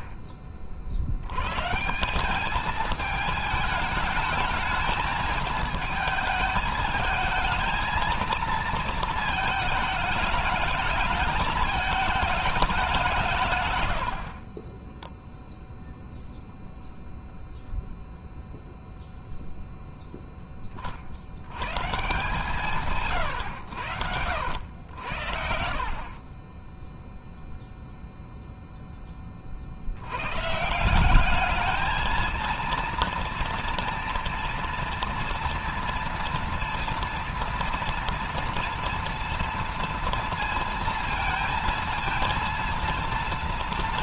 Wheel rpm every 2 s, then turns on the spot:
50, 210, 220, 220, 230, 210, 200, 30, 0, 0, 30, 150, 80, 20, 0, 150, 230, 230, 230, 230, 230, 230.
14-16 26-28